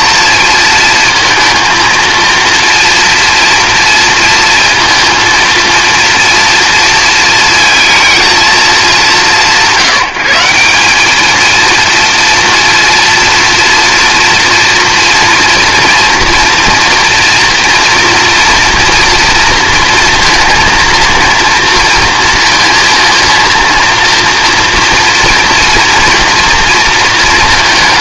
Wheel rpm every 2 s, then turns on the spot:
230, 230, 230, 230, 210, 190, 230, 230, 230, 230, 230, 230, 230, 230.
none